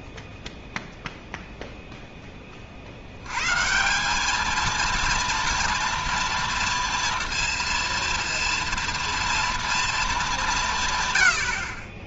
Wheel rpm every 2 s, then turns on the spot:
0, 40, 220, 230, 230, 190.
none